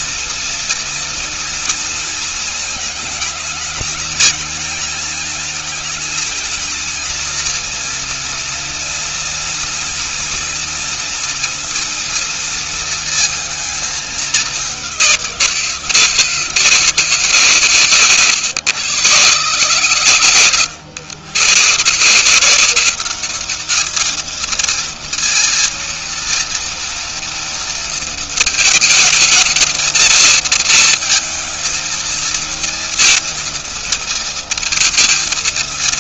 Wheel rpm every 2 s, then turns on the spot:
230, 220, 220, 230, 230, 230, 230, 190, 150, 120, 100, 180, 230, 230, 220, 230, 230, 230.
none